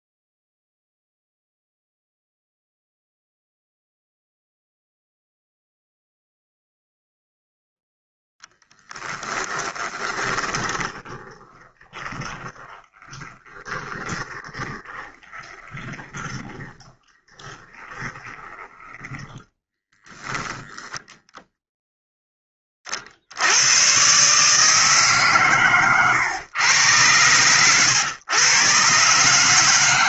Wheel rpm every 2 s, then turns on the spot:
0, 0, 0, 0, 10, 20, 30, 20, 10, 10, 10, 10, 150, 120, 130.
10-20